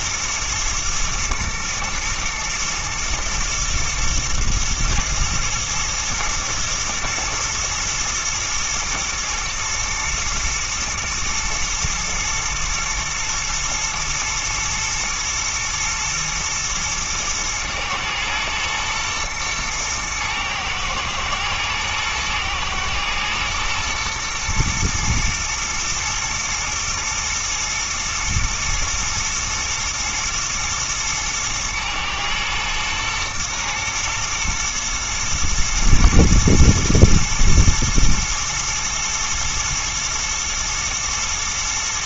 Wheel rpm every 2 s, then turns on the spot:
120, 120, 110, 120, 110, 120, 110, 110, 110, 110, 110, 110, 110, 110, 120, 120, 120, 120, 110, 110, 110.
none